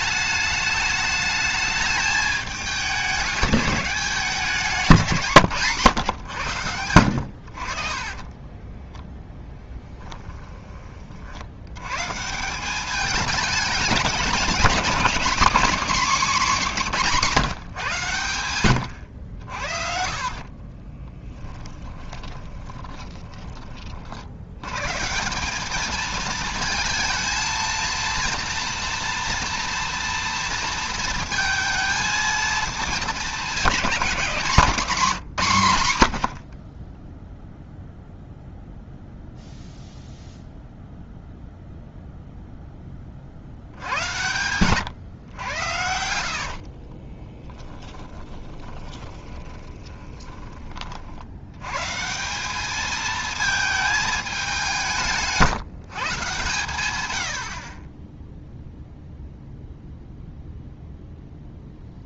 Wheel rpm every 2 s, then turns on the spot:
210, 200, 180, 100, 10, 20, 190, 200, 190, 100, 30, 10, 130, 220, 230, 230, 220, 180, 0, 0, 0, 10, 120, 40, 20, 40, 210, 180, 100, 0, 0.
6-10 20-24 46-50